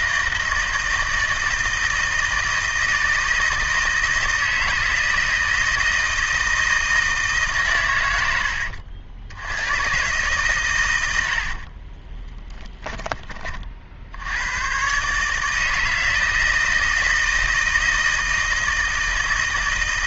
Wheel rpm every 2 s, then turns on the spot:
160, 160, 160, 160, 90, 120, 10, 130, 160, 160.
none